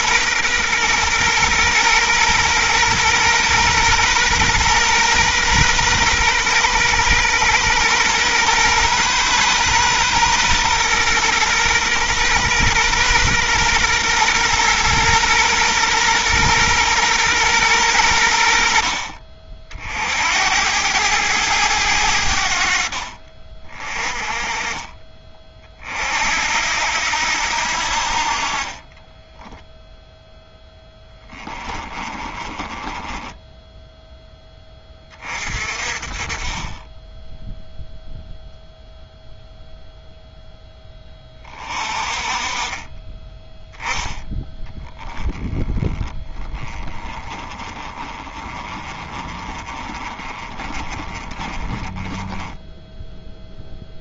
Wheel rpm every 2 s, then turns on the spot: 120, 120, 120, 120, 120, 120, 120, 120, 120, 50, 100, 60, 20, 80, 20, 10, 10, 20, 20, 0, 10, 20, 10, 20, 20, 30, 10.
28-34 44-54